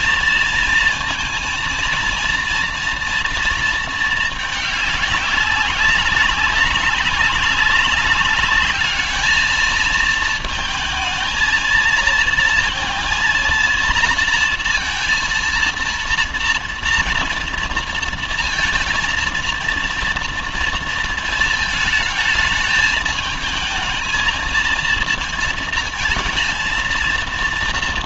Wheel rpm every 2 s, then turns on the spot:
230, 230, 210, 190, 200, 230, 230, 230, 230, 230, 230, 220, 220, 230.
none